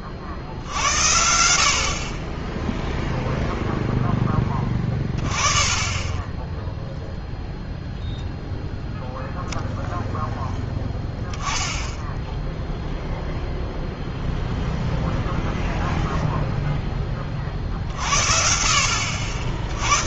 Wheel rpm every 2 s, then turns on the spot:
70, 0, 20, 0, 0, 10, 0, 0, 10, 70.
none